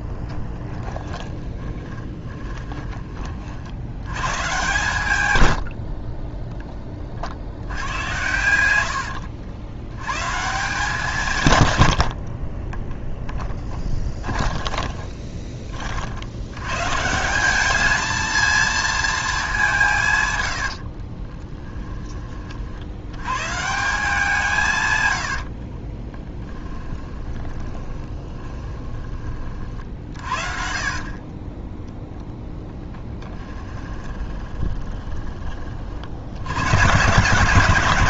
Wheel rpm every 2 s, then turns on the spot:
10, 20, 130, 20, 90, 150, 10, 20, 120, 230, 70, 70, 140, 20, 20, 40, 10, 20, 100.
0-2 4-6 8-10 12-16 20-22 26-28 30-36